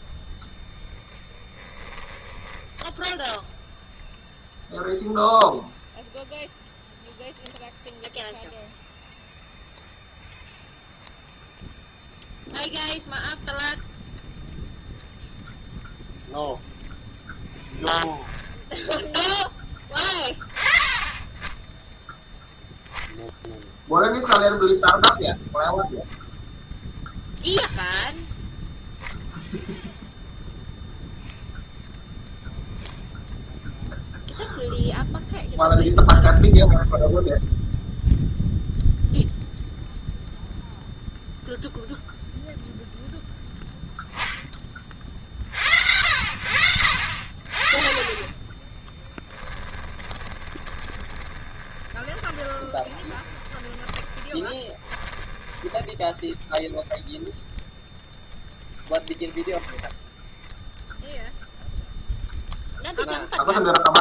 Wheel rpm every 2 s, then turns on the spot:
0, 0, 0, 0, 0, 0, 0, 0, 0, 0, 10, 0, 0, 0, 0, 0, 0, 0, 0, 0, 0, 0, 30, 70, 10, 20, 20, 10, 0, 0, 0, 0.
48-56